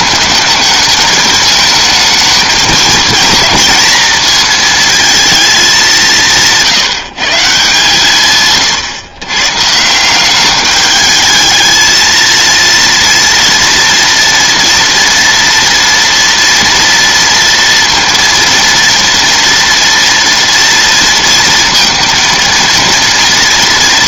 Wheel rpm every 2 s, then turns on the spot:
210, 220, 230, 170, 130, 210, 230, 230, 230, 230, 230, 230.
none